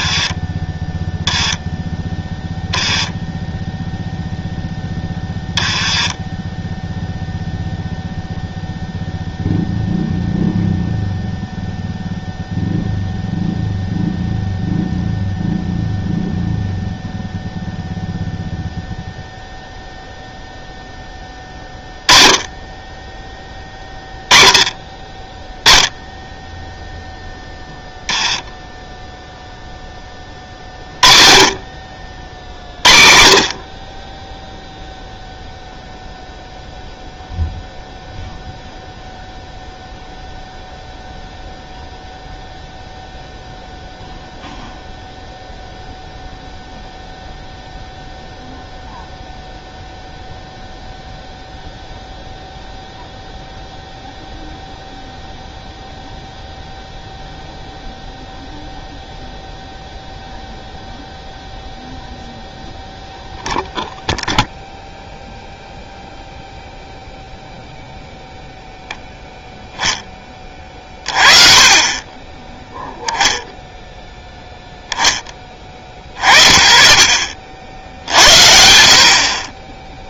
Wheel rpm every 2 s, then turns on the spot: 10, 0, 0, 0, 0, 0, 0, 0, 0, 0, 0, 10, 10, 0, 10, 30, 40, 0, 0, 0, 0, 0, 0, 0, 0, 0, 0, 0, 0, 0, 0, 0, 0, 0, 0, 30, 0, 0, 30, 50.
none